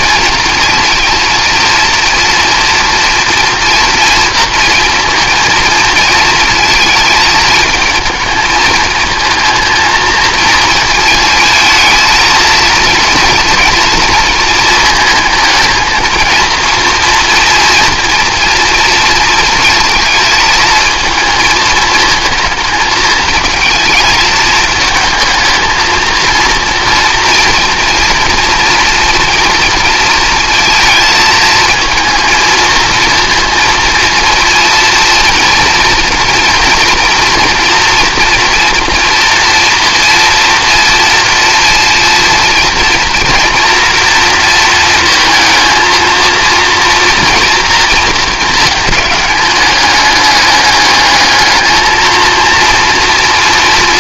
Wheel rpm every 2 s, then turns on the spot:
220, 240, 230, 220, 220, 220, 230, 220, 230, 230, 220, 220, 220, 230, 230, 230, 220, 230, 230, 240, 230, 230, 230, 230, 220, 210, 230.
none